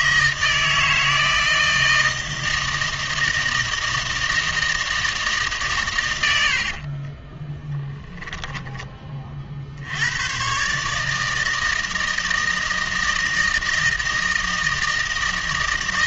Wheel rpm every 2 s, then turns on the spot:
160, 160, 160, 50, 10, 140, 160, 160.
6-8